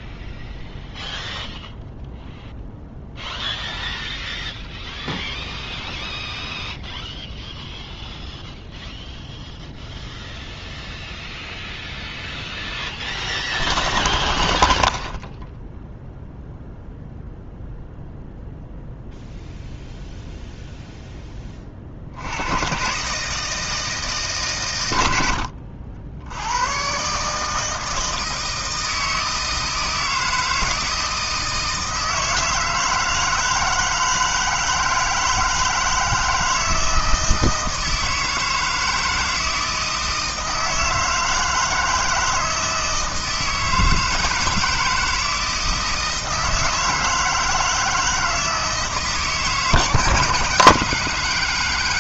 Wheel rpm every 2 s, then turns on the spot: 0, 0, 0, 0, 0, 0, 0, 0, 0, 0, 0, 90, 120, 110, 160, 160, 160, 160, 160, 160, 160, 160, 160, 160, 160, 140.
none